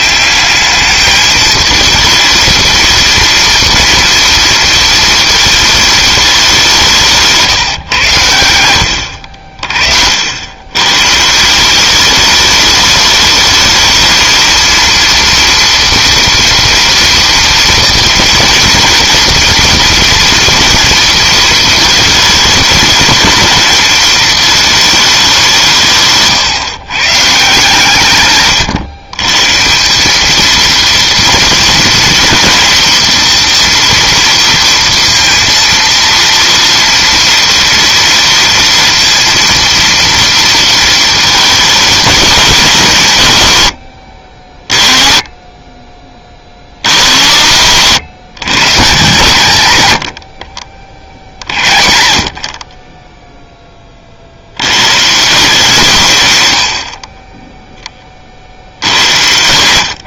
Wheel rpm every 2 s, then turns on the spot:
210, 230, 230, 190, 80, 100, 210, 230, 230, 230, 230, 220, 220, 130, 140, 230, 230, 230, 230, 230, 230, 210, 50, 70, 150, 60, 30, 100, 80, 70.
none